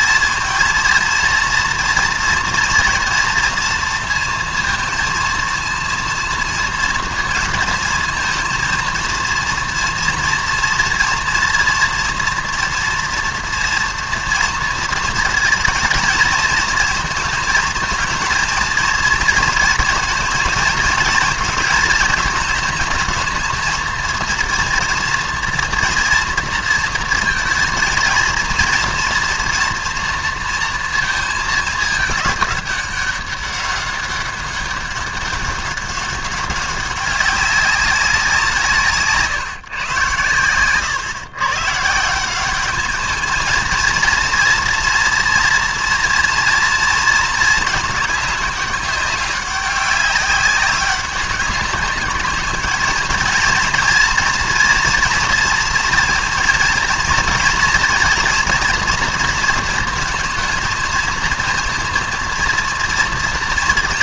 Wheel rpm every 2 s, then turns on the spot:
220, 230, 230, 230, 230, 240, 230, 230, 220, 220, 220, 220, 230, 230, 230, 230, 210, 190, 200, 180, 120, 170, 230, 230, 210, 190, 210, 230, 230, 230, 230, 230.
none